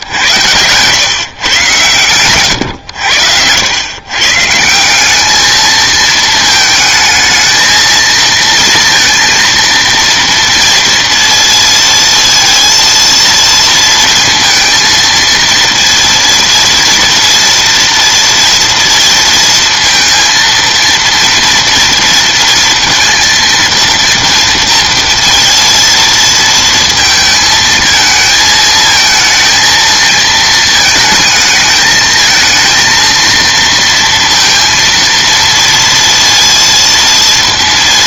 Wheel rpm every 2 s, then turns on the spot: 100, 100, 170, 220, 230, 230, 230, 230, 230, 230, 230, 230, 230, 230, 230, 230, 230, 230, 230.
none